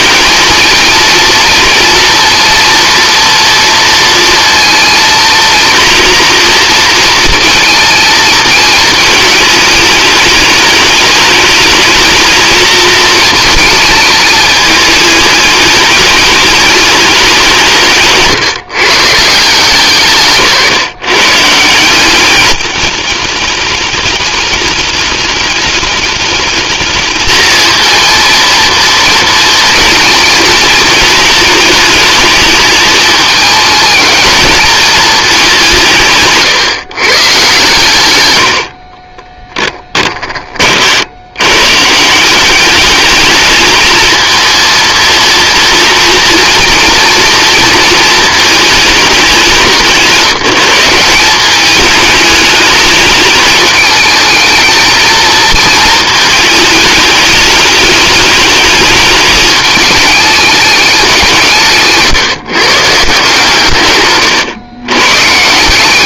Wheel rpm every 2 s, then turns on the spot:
220, 230, 230, 230, 220, 210, 230, 210, 210, 120, 160, 210, 210, 220, 230, 220, 220, 220, 140, 50, 60, 210, 230, 230, 210, 180, 210, 220, 220, 210, 190, 150, 120.
none